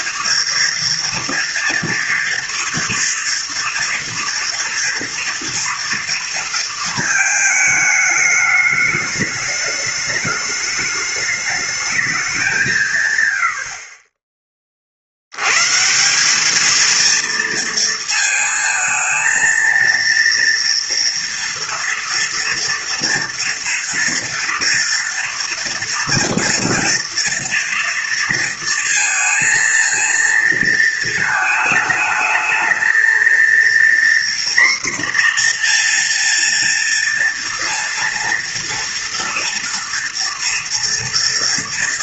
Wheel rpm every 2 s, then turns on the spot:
230, 230, 230, 230, 210, 210, 190, 30, 210, 230, 230, 230, 230, 230, 230, 230, 220, 240, 230, 230, 230.
none